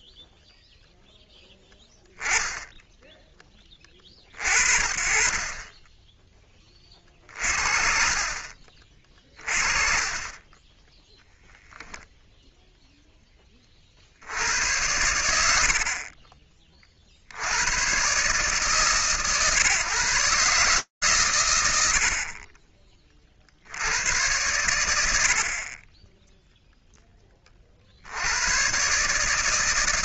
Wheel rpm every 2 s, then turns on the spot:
10, 10, 10, 20, 30, 0, 20, 80, 70, 140, 90, 70, 40, 30, 160.
none